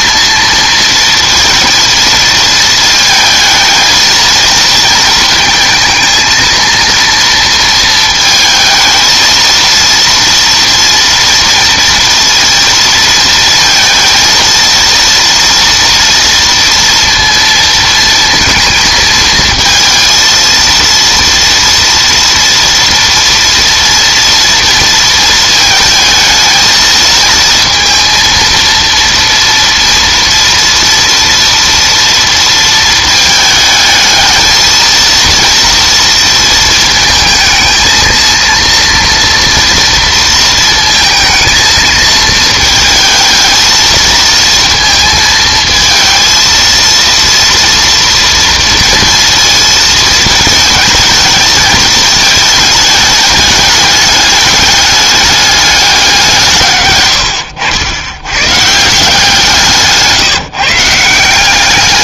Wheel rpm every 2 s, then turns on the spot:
230, 220, 230, 230, 220, 230, 230, 230, 230, 230, 230, 230, 230, 220, 230, 230, 230, 220, 230, 230, 220, 220, 230, 230, 230, 220, 210, 210, 130, 140, 150.
none